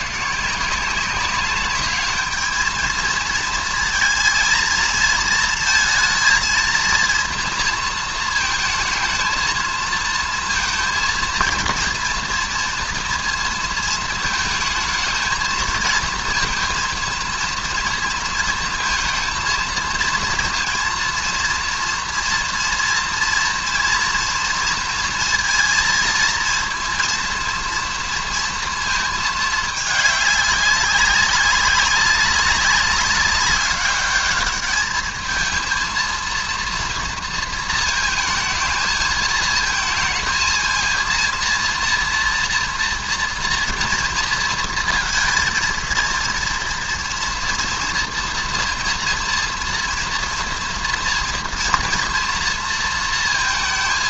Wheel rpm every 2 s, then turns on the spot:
160, 220, 220, 230, 230, 230, 230, 220, 230, 230, 230, 230, 230, 230, 230, 200, 200, 210, 230, 220, 220, 230, 230, 230, 230, 230, 230.
none